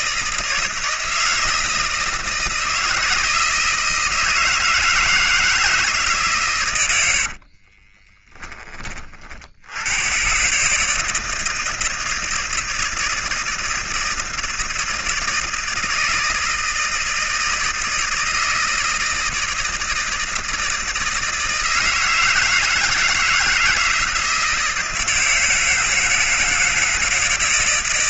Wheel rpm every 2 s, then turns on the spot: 160, 160, 160, 120, 20, 140, 160, 160, 160, 160, 160, 160, 160, 160.
none